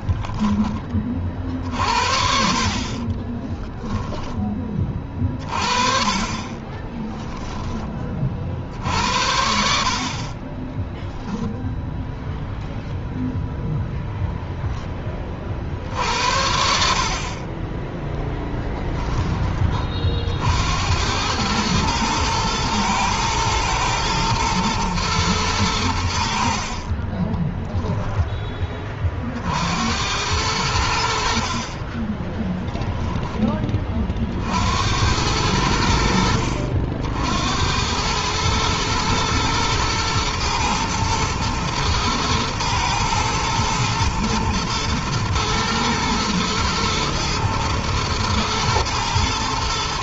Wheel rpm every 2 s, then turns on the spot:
20, 50, 30, 30, 50, 20, 0, 10, 60, 10, 70, 110, 120, 60, 20, 90, 10, 70, 70, 110, 110, 110, 110, 110, 110.
2-4 6-8 10-12